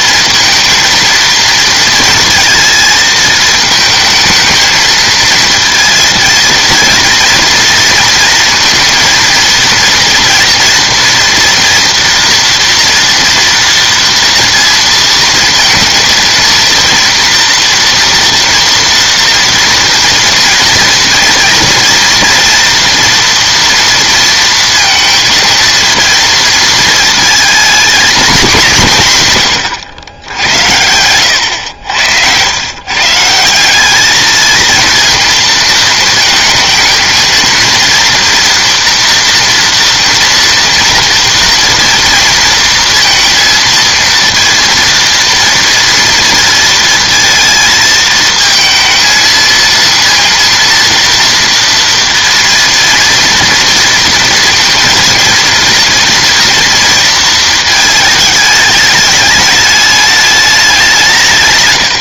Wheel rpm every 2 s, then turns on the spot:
230, 220, 220, 230, 230, 230, 230, 230, 230, 230, 230, 240, 230, 230, 190, 90, 110, 220, 220, 230, 230, 230, 230, 230, 220, 230, 230, 230, 230, 210, 200.
none